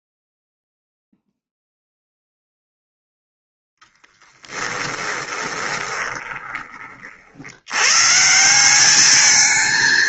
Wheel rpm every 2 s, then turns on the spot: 0, 0, 10, 50, 200.
4-6